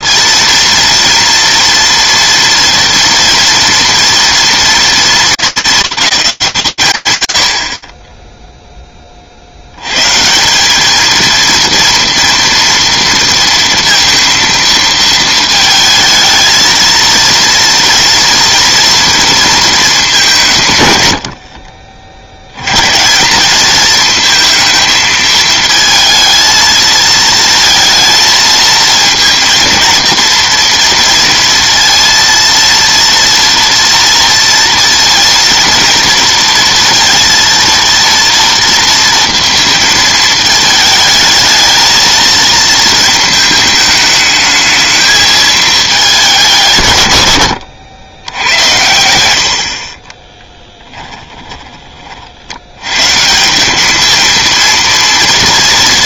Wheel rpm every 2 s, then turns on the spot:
230, 230, 230, 160, 0, 180, 230, 230, 220, 230, 160, 100, 220, 220, 220, 230, 230, 230, 230, 230, 220, 230, 220, 170, 100, 20, 80, 230.
50-52